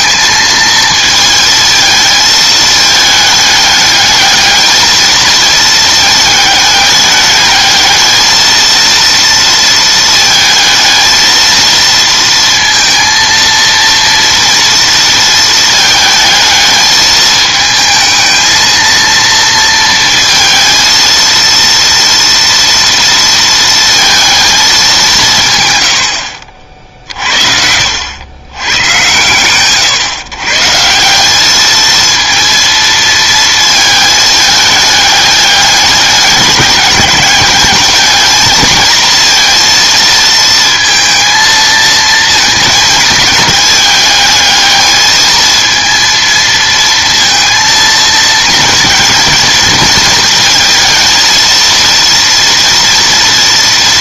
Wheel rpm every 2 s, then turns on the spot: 220, 220, 220, 210, 220, 220, 230, 230, 220, 220, 220, 230, 210, 50, 120, 150, 230, 210, 200, 220, 230, 220, 210, 230, 230, 230, 230.
none